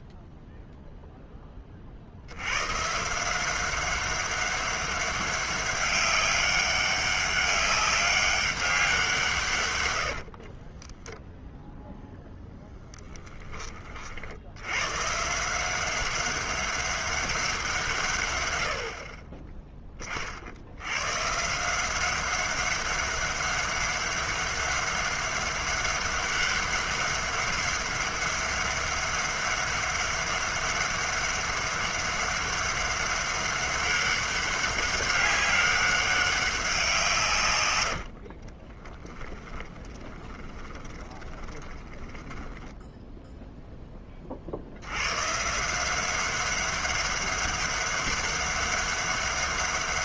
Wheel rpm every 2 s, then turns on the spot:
50, 190, 200, 200, 90, 10, 50, 190, 100, 40, 190, 200, 200, 200, 200, 200, 200, 200, 100, 10, 30, 10, 160, 200, 200.
8-10 36-42